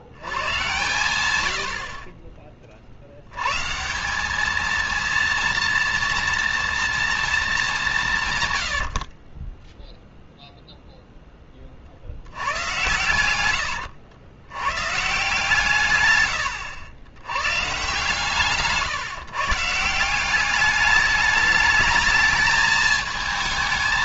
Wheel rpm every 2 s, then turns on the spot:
100, 30, 200, 230, 140, 0, 100, 110, 110, 150, 190, 220.
8-10 16-18